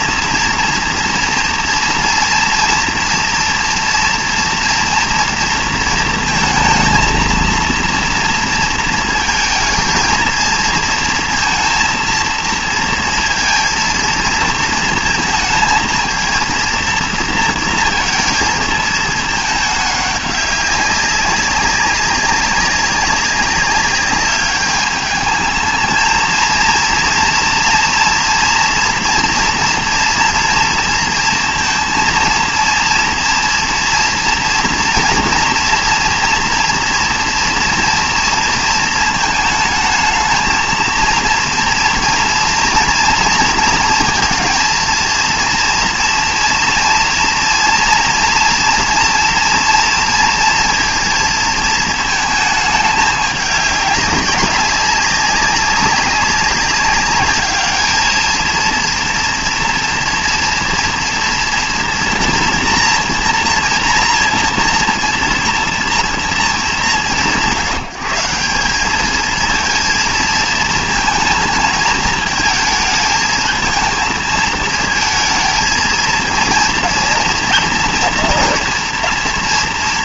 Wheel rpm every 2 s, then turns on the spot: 230, 240, 240, 220, 230, 230, 230, 230, 230, 230, 200, 190, 210, 230, 230, 230, 230, 230, 230, 230, 230, 230, 230, 230, 230, 230, 220, 200, 200, 230, 240, 230, 230, 210, 190, 230, 220, 220, 230, 230.
none